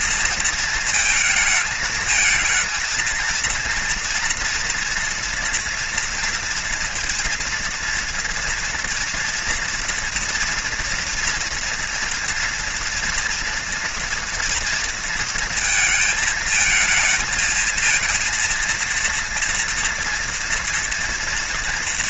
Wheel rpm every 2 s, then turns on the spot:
230, 230, 230, 230, 240, 230, 230, 230, 220, 230, 230.
none